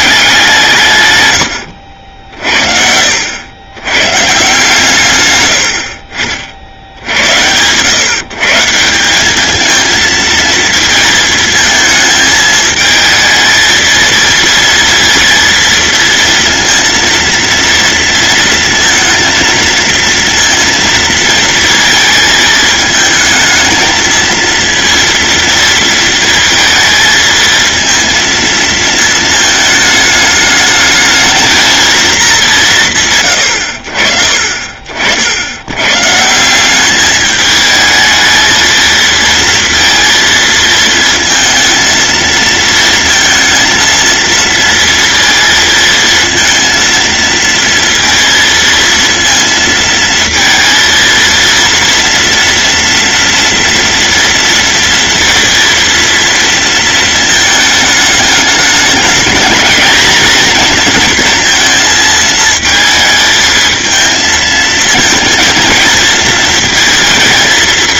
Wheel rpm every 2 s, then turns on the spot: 150, 60, 140, 80, 170, 220, 220, 230, 230, 230, 230, 220, 230, 230, 230, 210, 160, 50, 200, 220, 230, 230, 230, 230, 230, 230, 230, 230, 230, 210, 240, 220, 230, 220.
none